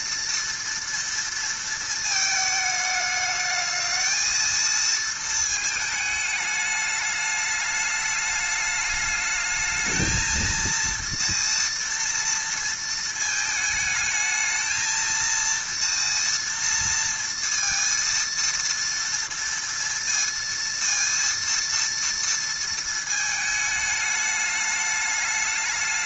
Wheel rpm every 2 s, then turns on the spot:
230, 220, 220, 210, 210, 230, 230, 220, 230, 230, 230, 230, 210.
none